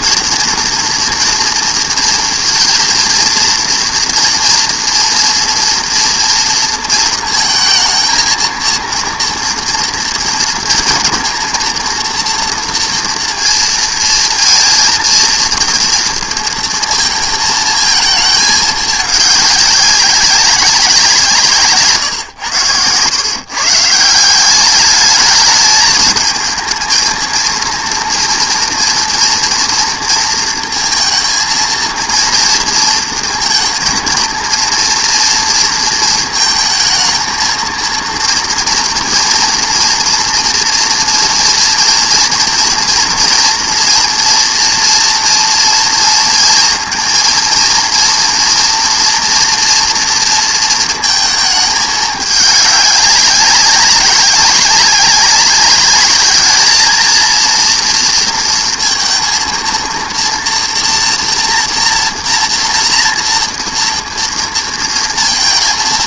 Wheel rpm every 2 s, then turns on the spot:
240, 230, 240, 230, 230, 230, 230, 230, 230, 220, 200, 110, 200, 220, 230, 230, 230, 230, 230, 230, 240, 230, 230, 230, 240, 230, 210, 200, 210, 230, 230, 240, 230.
none